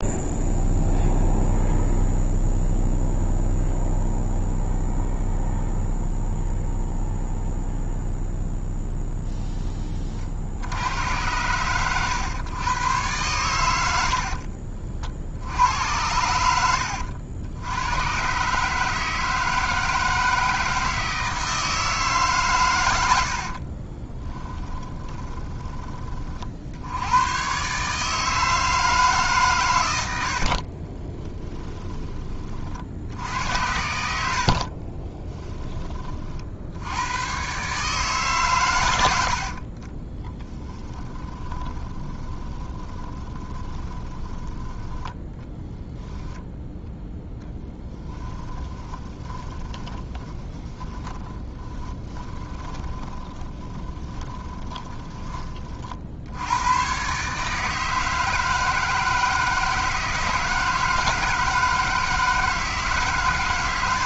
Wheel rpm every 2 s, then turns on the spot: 0, 0, 0, 0, 0, 70, 110, 50, 70, 140, 160, 110, 20, 70, 160, 40, 50, 40, 80, 120, 10, 20, 10, 0, 20, 20, 20, 20, 110, 160, 160, 150.
24-26 30-32 34-36 40-44 48-56